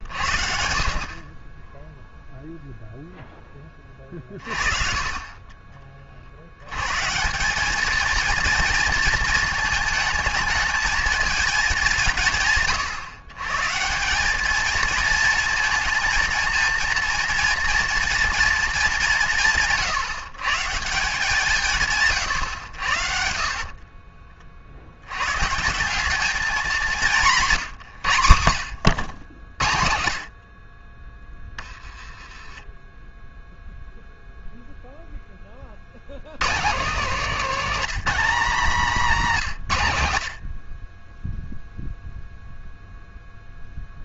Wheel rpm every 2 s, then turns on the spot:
50, 0, 30, 120, 230, 220, 130, 220, 230, 220, 150, 100, 70, 190, 100, 50, 10, 0, 170, 210, 40, 0.
4-6